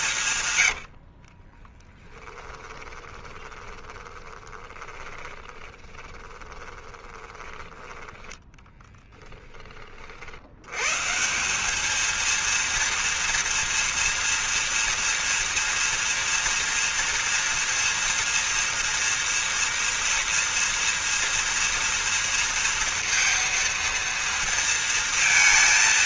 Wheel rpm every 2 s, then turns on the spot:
70, 10, 20, 20, 20, 130, 230, 240, 240, 230, 230, 230, 230.
0-10